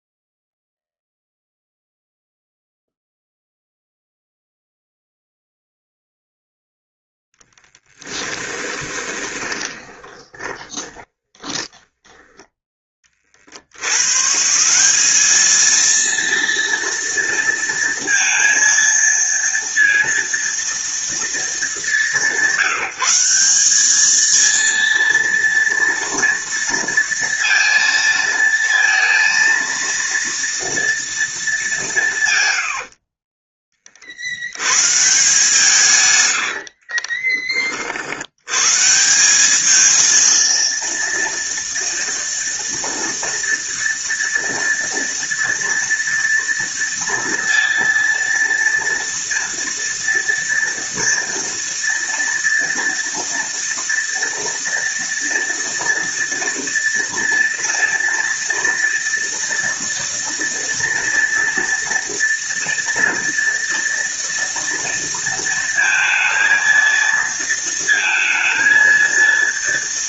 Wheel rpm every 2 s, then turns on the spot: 0, 0, 0, 0, 20, 20, 30, 200, 230, 230, 220, 190, 230, 230, 230, 230, 40, 140, 30, 180, 230, 230, 230, 230, 230, 230, 230, 230, 230, 230, 230, 230, 230, 230, 230.
8-12 36-38